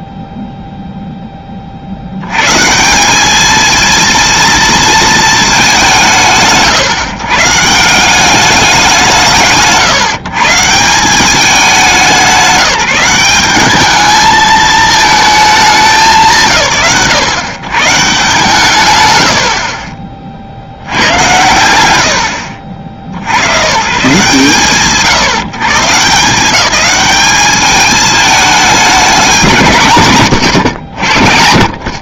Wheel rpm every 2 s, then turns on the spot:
0, 140, 230, 120, 160, 160, 180, 220, 100, 150, 90, 60, 140, 180, 210, 80.
none